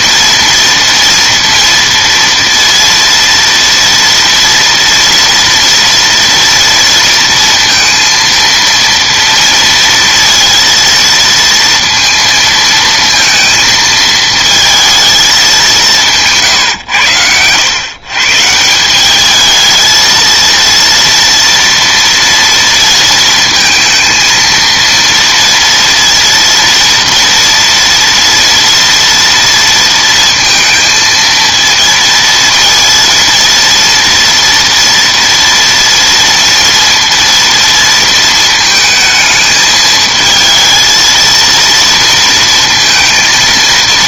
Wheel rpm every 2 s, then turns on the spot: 230, 230, 230, 230, 230, 230, 230, 220, 140, 170, 230, 230, 230, 230, 230, 230, 230, 230, 230, 220, 230, 230.
16-18